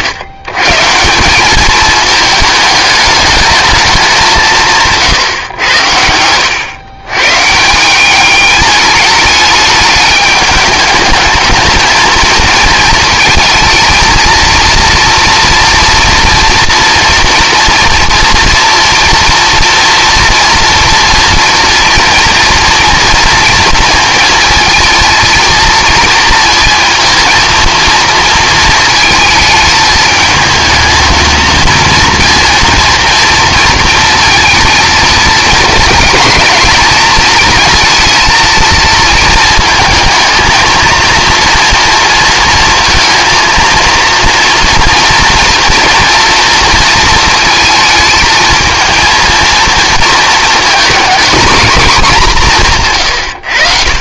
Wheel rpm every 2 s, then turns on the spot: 140, 210, 170, 110, 210, 210, 220, 230, 230, 230, 240, 230, 230, 230, 230, 220, 230, 230, 220, 230, 220, 230, 230, 230, 220, 220, 180.
none